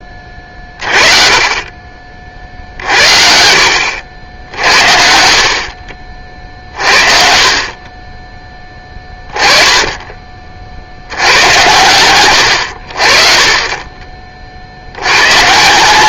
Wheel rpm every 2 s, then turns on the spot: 30, 60, 70, 50, 20, 60, 60, 80.
none